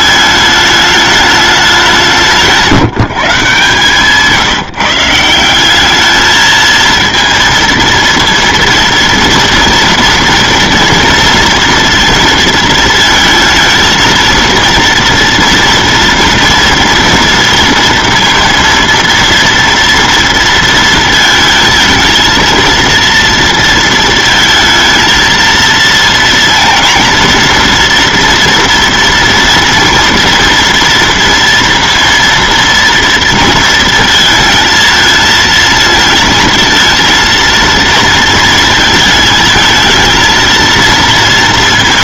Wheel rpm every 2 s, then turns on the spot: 210, 150, 160, 220, 230, 230, 230, 230, 230, 230, 230, 230, 230, 230, 240, 230, 230, 220, 220, 230, 230.
none